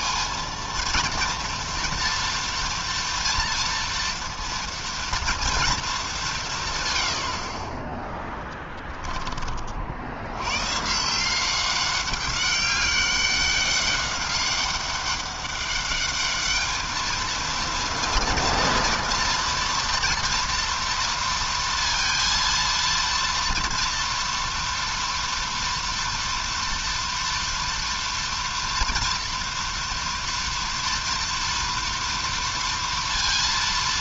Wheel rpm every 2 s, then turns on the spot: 230, 230, 230, 60, 30, 170, 200, 200, 220, 230, 230, 230, 230, 230, 230, 230, 230.
8-10